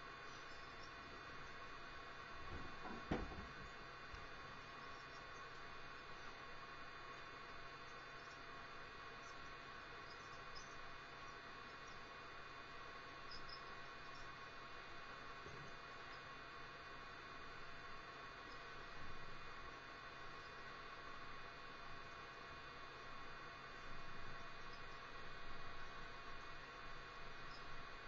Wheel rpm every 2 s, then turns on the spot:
0, 0, 0, 0, 0, 0, 0, 0, 0, 0, 0, 0, 0, 0.
none